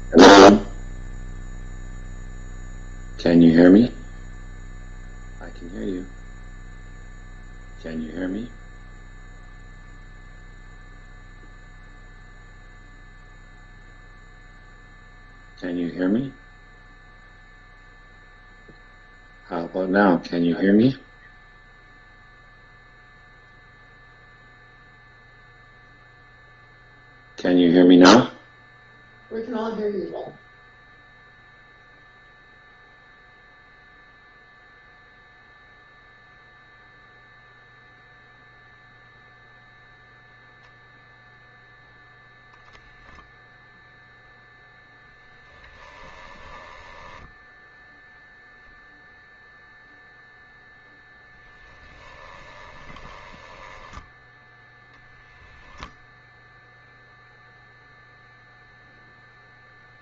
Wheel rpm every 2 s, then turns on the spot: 0, 0, 0, 0, 0, 0, 0, 0, 0, 0, 0, 0, 0, 0, 0, 0, 0, 0, 0, 0, 0, 0, 0, 10, 0, 0, 10, 10, 0, 0.
46-48 52-54